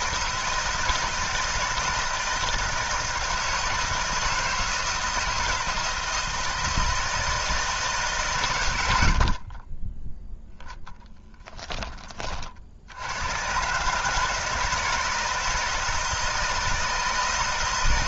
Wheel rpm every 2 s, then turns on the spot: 160, 160, 160, 160, 70, 10, 90, 160, 160.
none